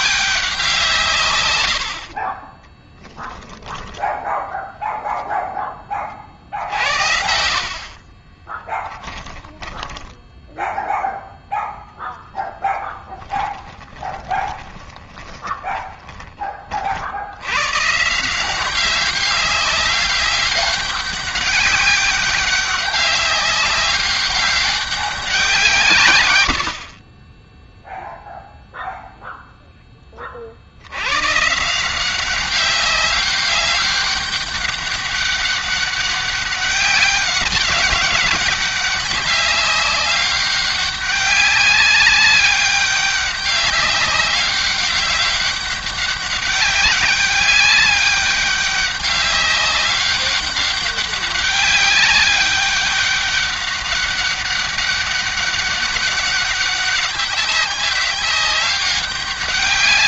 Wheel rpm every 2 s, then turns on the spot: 150, 10, 0, 80, 20, 0, 10, 20, 70, 190, 200, 200, 190, 30, 0, 90, 200, 200, 190, 200, 200, 200, 200, 200, 200, 200, 200, 200, 200, 200.
8-10 12-16